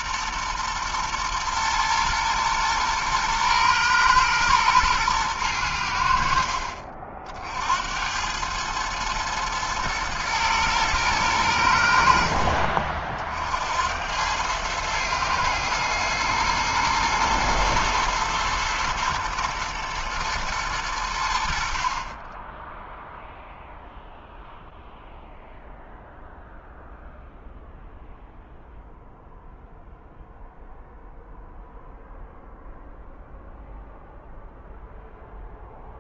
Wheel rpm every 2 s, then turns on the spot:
120, 120, 120, 50, 100, 120, 60, 100, 120, 120, 110, 20, 0, 0, 0, 0, 0, 0.
none